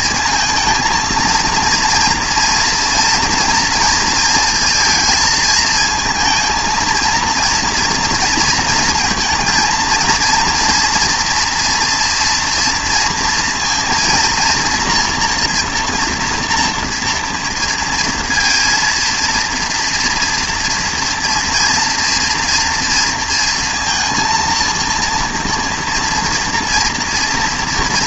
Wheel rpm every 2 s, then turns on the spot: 230, 230, 230, 220, 230, 230, 230, 230, 230, 230, 230, 230, 230, 230.
none